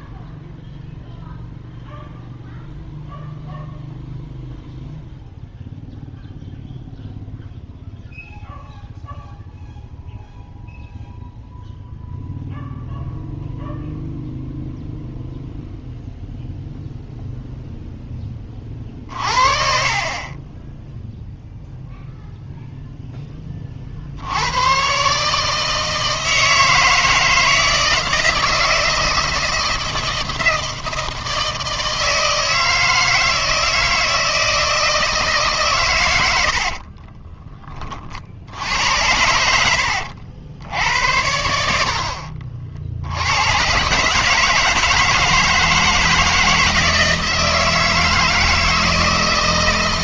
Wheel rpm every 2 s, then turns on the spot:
0, 0, 0, 0, 0, 0, 0, 0, 0, 30, 20, 0, 110, 160, 160, 160, 160, 160, 70, 70, 80, 60, 160, 160, 160.
36-38